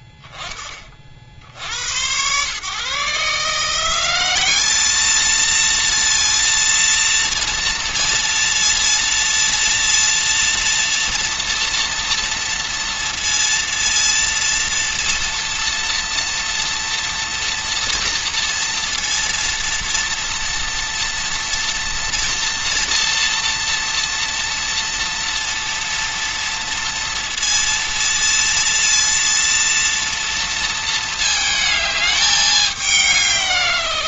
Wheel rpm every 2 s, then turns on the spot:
20, 130, 200, 230, 230, 230, 230, 230, 230, 230, 230, 230, 230, 230, 230, 230, 200.
none